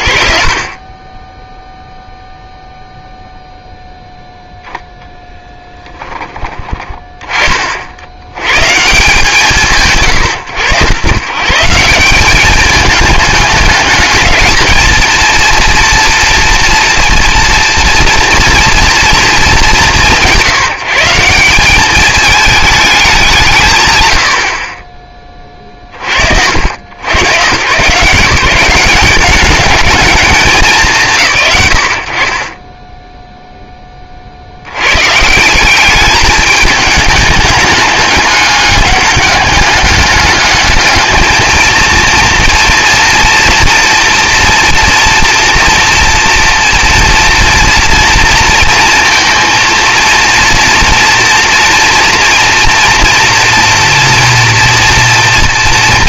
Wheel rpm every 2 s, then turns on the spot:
50, 0, 0, 20, 100, 100, 200, 220, 230, 230, 160, 220, 30, 100, 190, 150, 10, 90, 210, 210, 210, 230, 230, 230, 230, 230, 230, 230.
none